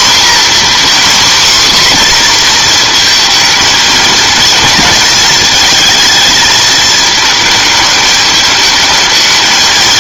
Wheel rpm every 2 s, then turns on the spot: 260, 240, 230, 220, 210.
none